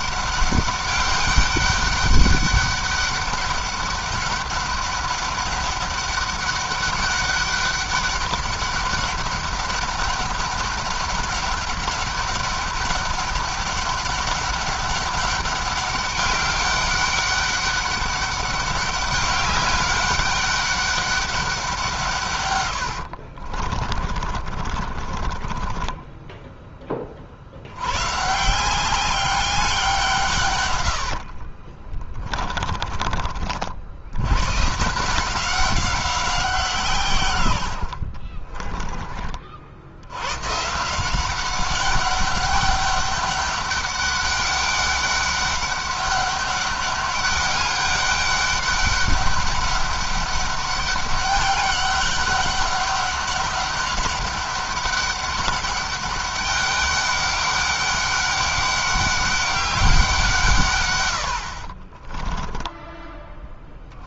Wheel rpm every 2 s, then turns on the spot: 200, 200, 200, 200, 200, 200, 200, 200, 200, 200, 200, 100, 30, 20, 170, 110, 20, 140, 170, 30, 150, 200, 200, 200, 200, 200, 200, 200, 200, 200, 140, 10.
22-26 30-32 38-40